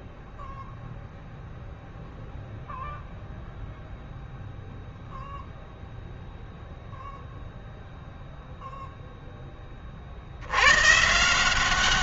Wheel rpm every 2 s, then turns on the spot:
0, 0, 0, 0, 0, 110.
none